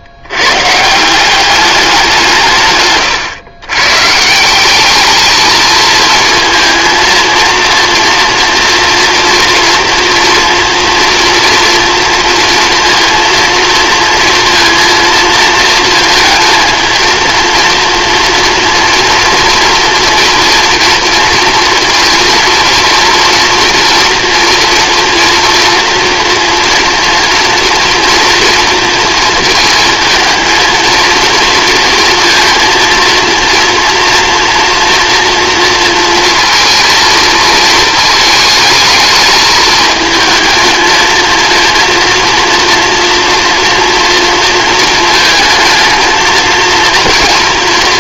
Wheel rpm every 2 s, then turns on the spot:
140, 140, 190, 230, 230, 240, 230, 230, 220, 230, 240, 230, 230, 230, 230, 230, 230, 230, 230, 220, 220, 230, 230, 230.
none